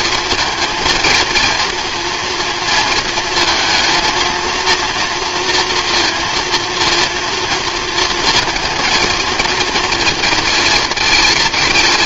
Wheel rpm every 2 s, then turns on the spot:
220, 230, 230, 230, 230, 220.
none